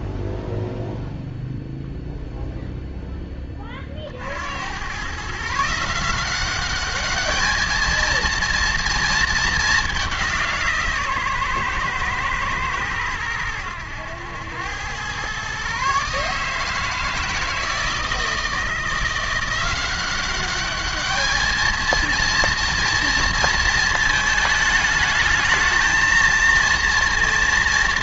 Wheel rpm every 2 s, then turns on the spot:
0, 0, 90, 200, 230, 170, 110, 100, 160, 160, 200, 230, 210, 230.
none